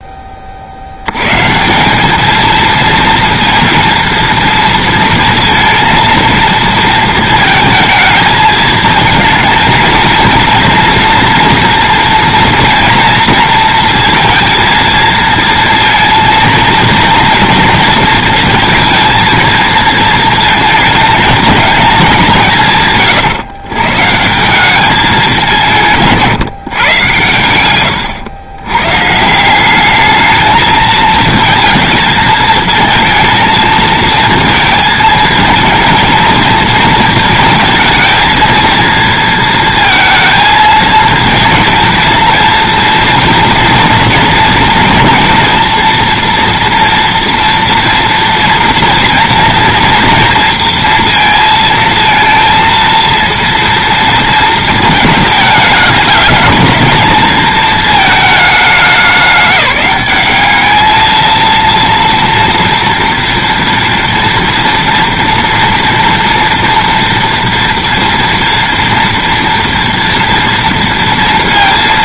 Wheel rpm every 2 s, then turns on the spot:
30, 230, 230, 230, 220, 230, 230, 230, 230, 230, 220, 160, 190, 140, 100, 220, 220, 230, 220, 230, 230, 230, 230, 230, 230, 230, 230, 220, 220, 200, 210, 230, 230, 230, 230, 230.
none